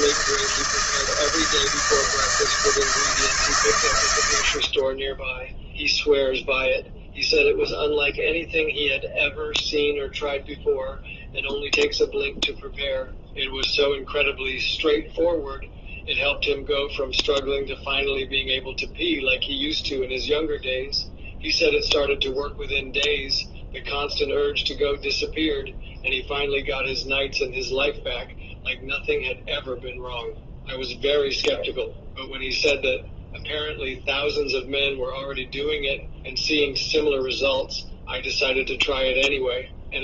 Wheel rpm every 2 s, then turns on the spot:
160, 160, 70, 0, 0, 0, 0, 0, 0, 0, 0, 0, 0, 0, 0, 0, 0, 0, 0, 0.
none